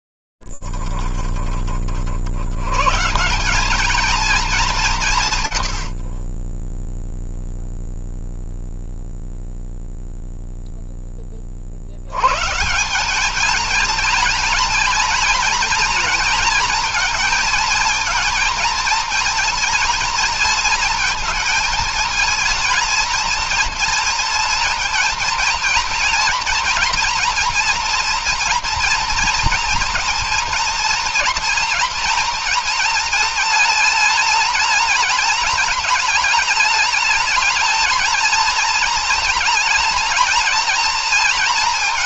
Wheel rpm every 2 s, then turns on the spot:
10, 60, 220, 50, 0, 0, 140, 230, 220, 230, 230, 220, 230, 240, 230, 230, 230, 220, 220, 230, 230.
none